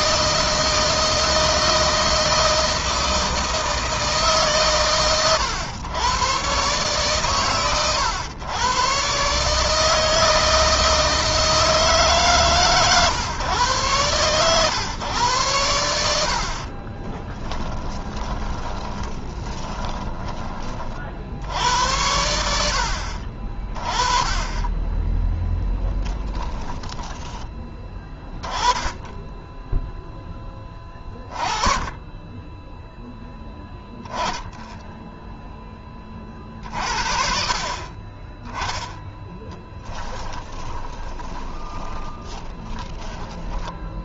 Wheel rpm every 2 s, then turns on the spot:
160, 160, 130, 120, 110, 160, 140, 120, 40, 10, 20, 70, 20, 10, 10, 10, 10, 10, 50, 10, 10, 30.
16-20 26-28 40-44